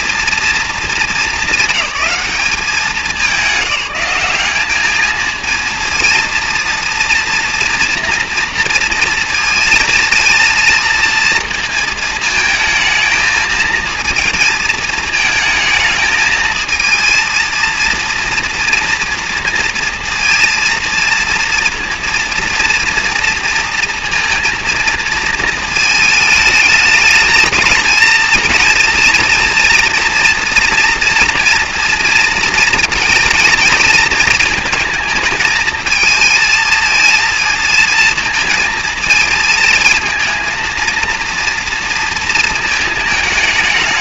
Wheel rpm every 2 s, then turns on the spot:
220, 200, 210, 230, 230, 230, 220, 230, 220, 230, 230, 230, 230, 220, 230, 230, 230, 220, 220, 220, 230, 220.
none